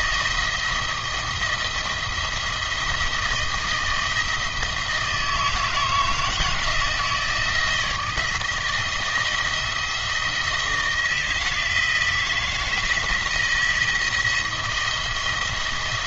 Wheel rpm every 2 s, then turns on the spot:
170, 160, 160, 160, 160, 160, 160, 170.
none